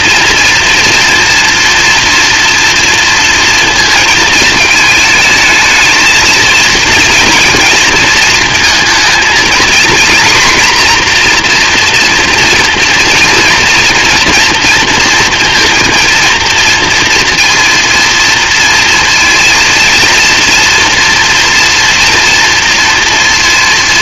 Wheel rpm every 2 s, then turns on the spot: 230, 230, 220, 220, 230, 240, 230, 240, 230, 230, 240, 230.
none